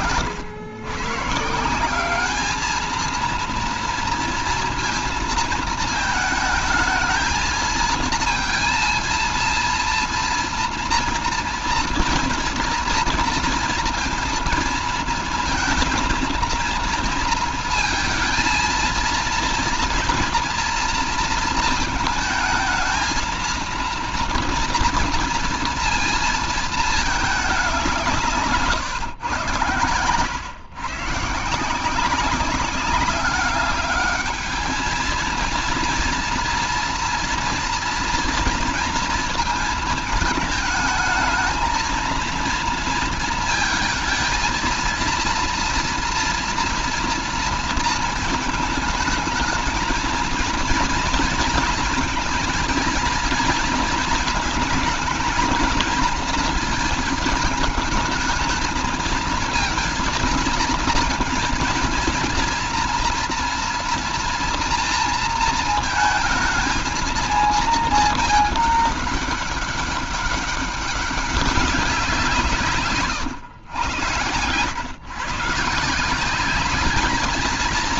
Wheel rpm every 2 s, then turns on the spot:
130, 220, 230, 220, 230, 230, 230, 230, 230, 230, 230, 220, 230, 210, 120, 140, 190, 220, 240, 230, 220, 230, 230, 230, 220, 230, 230, 230, 220, 230, 230, 230, 230, 220, 200, 200, 140, 120, 210.
none